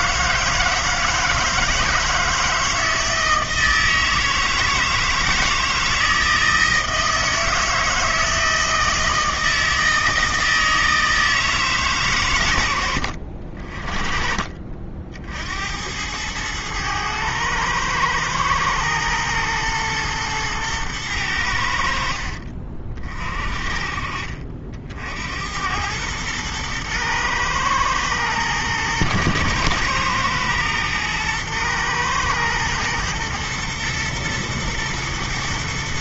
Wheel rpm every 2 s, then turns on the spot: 160, 160, 160, 160, 160, 160, 80, 50, 110, 110, 110, 40, 60, 110, 120, 120, 110, 120.
none